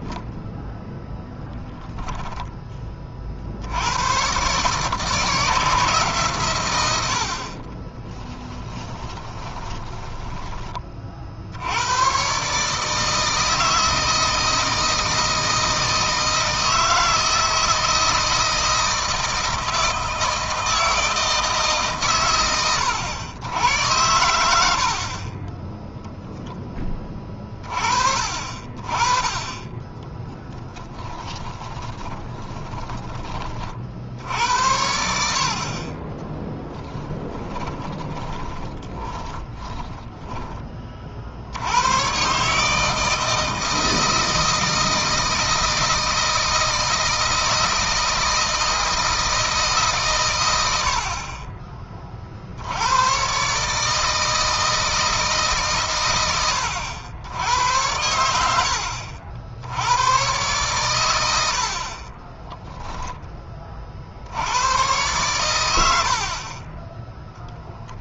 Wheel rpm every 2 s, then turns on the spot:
0, 30, 150, 90, 20, 30, 150, 160, 160, 160, 160, 110, 60, 20, 50, 10, 10, 70, 20, 30, 30, 150, 160, 160, 160, 70, 90, 160, 90, 70, 110, 10, 110, 20.
6-10 30-32 36-40